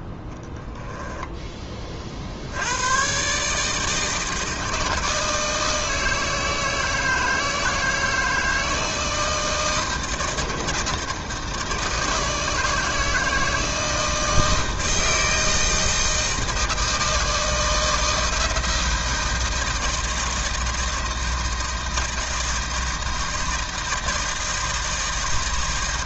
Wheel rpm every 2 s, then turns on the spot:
10, 90, 160, 160, 160, 160, 160, 160, 160, 160, 160, 160, 160.
0-2